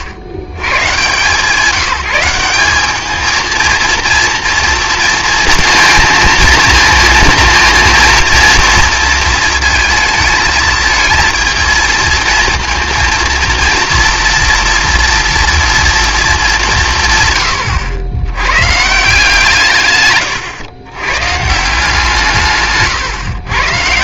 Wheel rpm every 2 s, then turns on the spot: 100, 200, 230, 220, 230, 220, 230, 240, 190, 130, 120, 150.
none